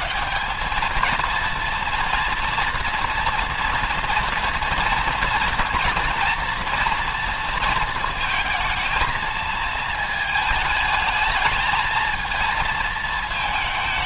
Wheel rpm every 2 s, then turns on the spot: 210, 230, 230, 230, 230, 220, 230.
none